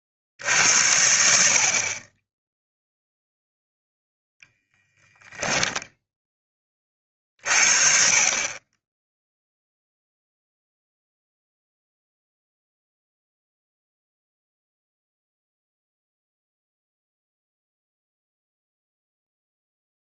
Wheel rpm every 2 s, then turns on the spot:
70, 10, 0, 20, 20, 0, 0, 0, 0, 0.
none